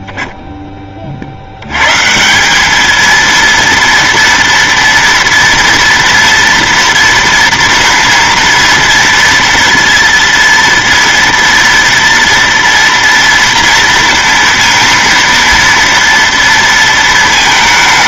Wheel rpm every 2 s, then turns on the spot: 20, 200, 230, 230, 230, 230, 230, 230, 230.
none